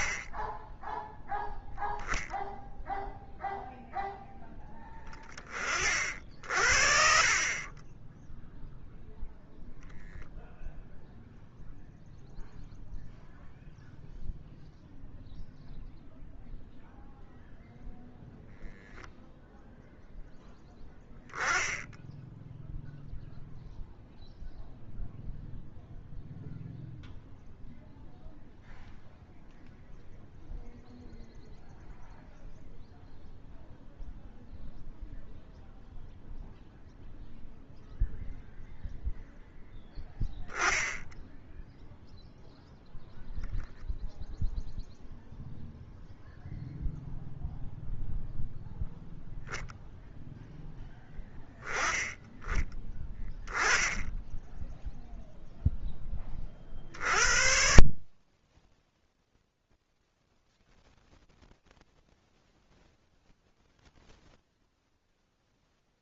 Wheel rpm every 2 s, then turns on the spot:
10, 0, 10, 50, 0, 0, 0, 0, 0, 0, 0, 0, 0, 0, 0, 0, 0, 0, 0, 0, 10, 0, 0, 0, 0, 0, 10, 0, 40, 20, 120, 20, 10.
none